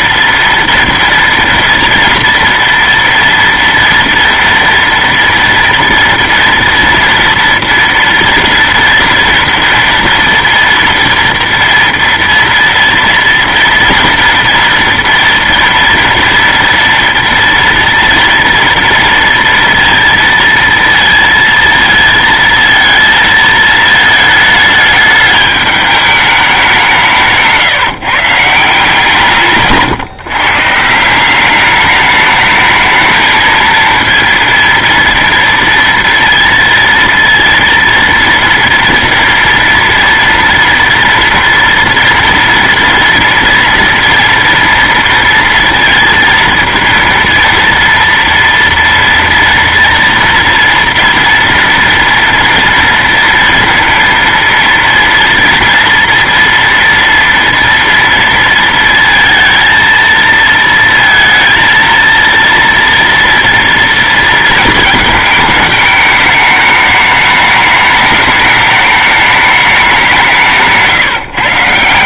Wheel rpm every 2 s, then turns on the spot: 230, 230, 230, 230, 230, 230, 230, 230, 240, 230, 230, 220, 210, 200, 160, 150, 210, 230, 230, 230, 230, 230, 230, 230, 230, 230, 230, 230, 230, 230, 230, 230, 220, 210, 210, 160.
70-72